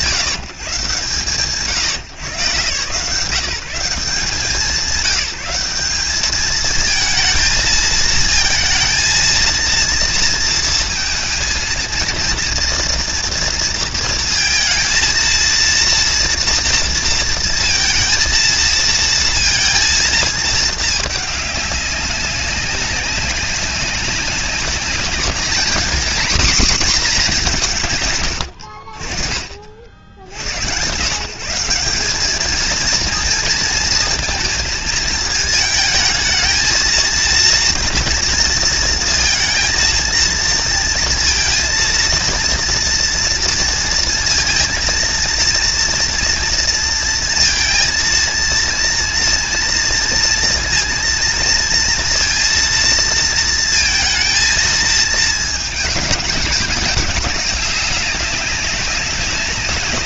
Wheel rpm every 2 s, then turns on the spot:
130, 120, 180, 220, 230, 230, 230, 230, 230, 230, 220, 190, 200, 250, 70, 100, 220, 220, 220, 230, 230, 230, 230, 230, 230, 230, 230, 230, 210, 200.
none